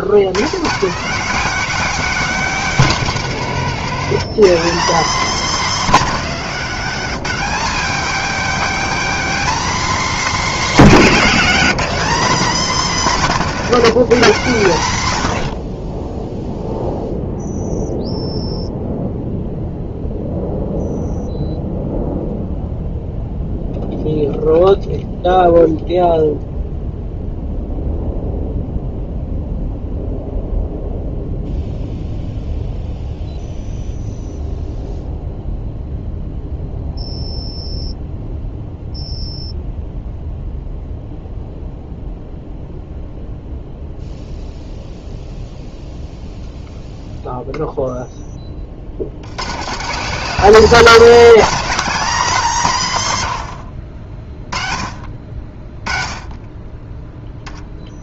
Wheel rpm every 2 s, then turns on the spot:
110, 230, 220, 220, 260, 230, 230, 150, 0, 0, 0, 0, 0, 0, 0, 0, 0, 0, 0, 0, 0, 0, 0, 0, 40, 180, 200, 30, 20.
none